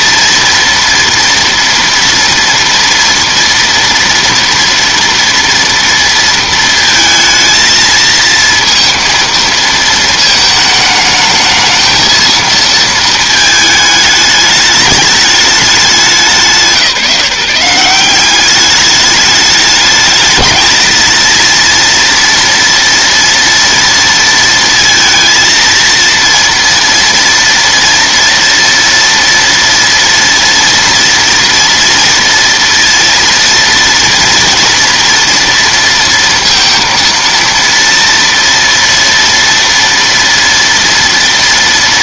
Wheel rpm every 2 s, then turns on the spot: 230, 240, 230, 230, 230, 220, 230, 210, 180, 200, 220, 230, 230, 230, 230, 230, 230, 230, 230, 230, 230.
none